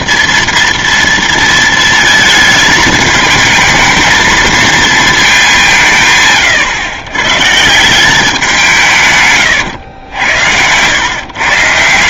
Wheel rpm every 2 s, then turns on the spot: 230, 220, 230, 130, 180, 100.
10-12